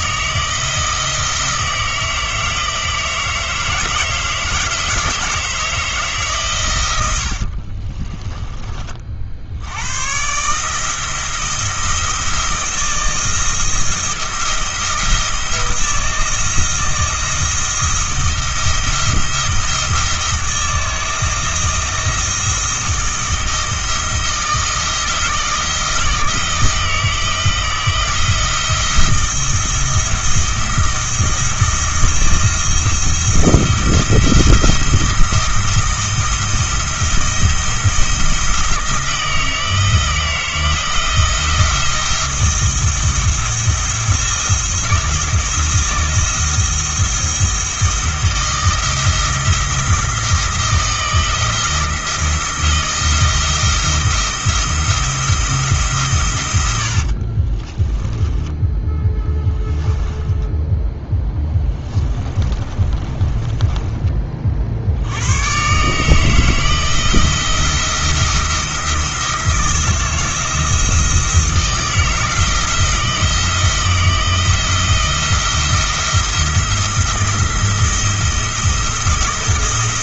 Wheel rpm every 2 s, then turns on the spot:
160, 160, 160, 110, 30, 160, 170, 170, 160, 170, 160, 160, 170, 160, 170, 170, 170, 170, 170, 170, 170, 170, 170, 160, 160, 160, 170, 170, 80, 20, 20, 30, 60, 160, 170, 170, 160, 170, 170, 160.
6-8 58-64